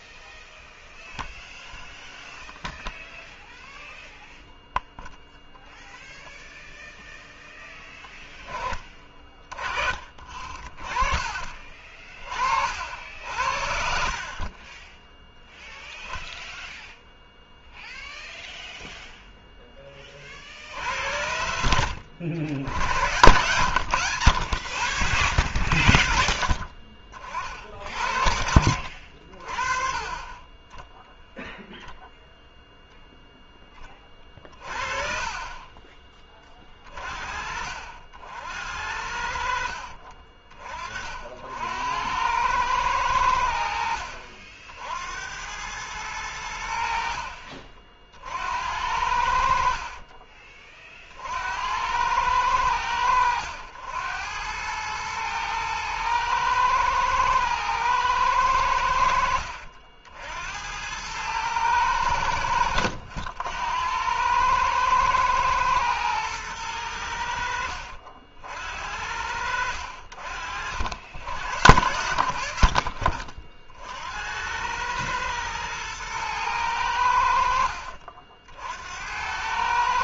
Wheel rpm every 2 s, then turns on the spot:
0, 0, 0, 0, 30, 30, 60, 20, 0, 0, 70, 90, 50, 50, 60, 10, 0, 30, 40, 70, 40, 100, 70, 70, 80, 40, 90, 110, 110, 80, 90, 80, 110, 100, 60, 70, 50, 100, 90, 70.
10-12 34-36